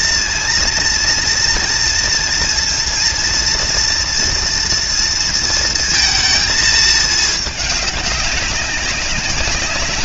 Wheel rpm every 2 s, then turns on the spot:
230, 230, 240, 220, 190.
none